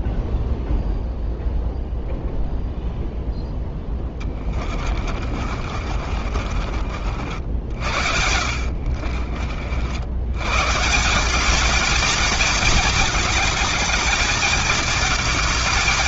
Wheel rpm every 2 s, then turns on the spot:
0, 0, 20, 50, 80, 110, 220, 220.
4-10